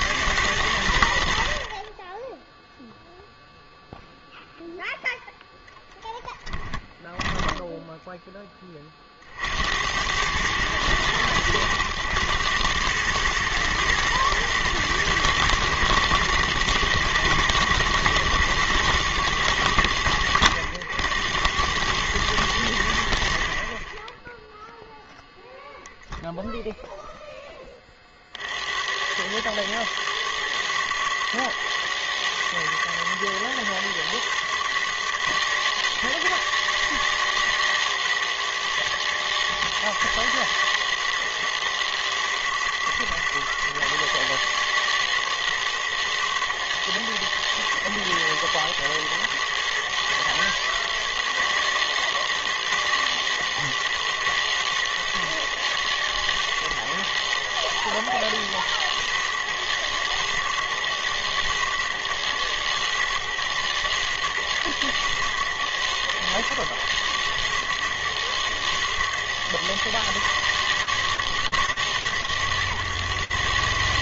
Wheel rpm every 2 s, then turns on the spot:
90, 10, 0, 10, 20, 110, 110, 110, 120, 120, 100, 70, 0, 10, 100, 110, 120, 130, 150, 120, 130, 130, 130, 120, 130, 140, 130, 120, 110, 120, 110, 120, 110, 120, 120, 130, 130.
6-8